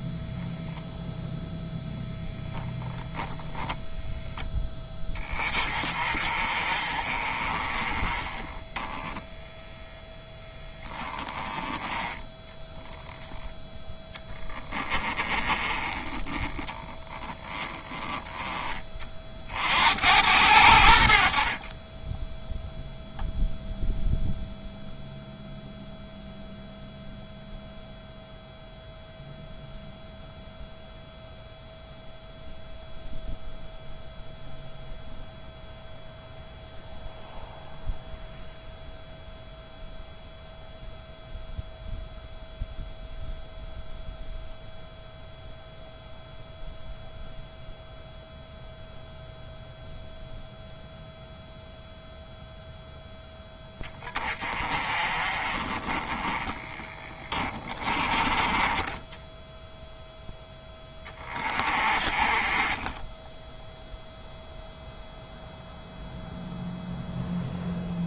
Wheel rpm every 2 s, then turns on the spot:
0, 0, 10, 30, 10, 10, 0, 20, 10, 30, 70, 0, 0, 0, 0, 0, 0, 0, 0, 0, 0, 0, 0, 0, 0, 0, 0, 30, 20, 20, 10, 20, 0, 0.
16-18 56-60